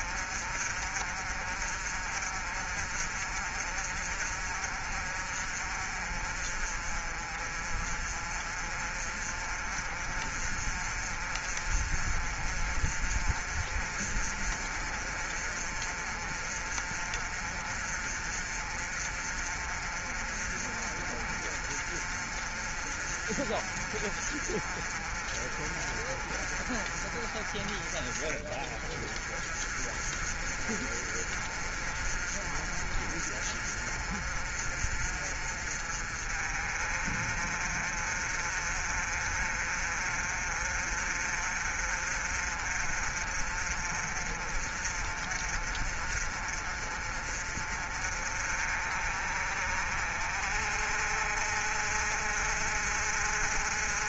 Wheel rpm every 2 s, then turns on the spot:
50, 50, 50, 40, 40, 50, 40, 40, 40, 40, 40, 40, 40, 40, 40, 40, 40, 40, 40, 40, 40, 40, 40, 40, 40, 50, 50.
none